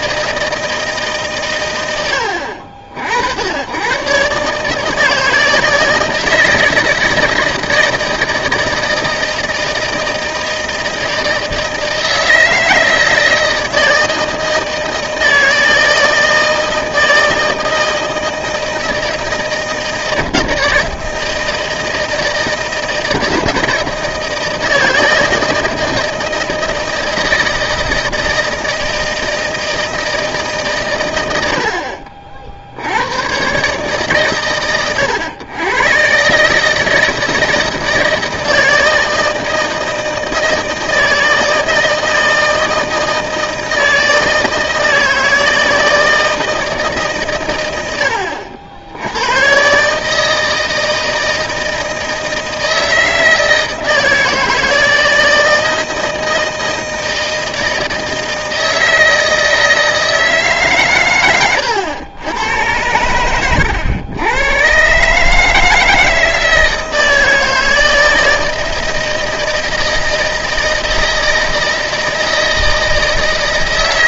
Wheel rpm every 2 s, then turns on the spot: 160, 70, 150, 160, 160, 160, 160, 160, 160, 160, 160, 160, 160, 160, 160, 140, 60, 120, 150, 160, 160, 160, 160, 160, 80, 160, 160, 160, 160, 160, 140, 100, 120, 160, 160, 160, 160.
none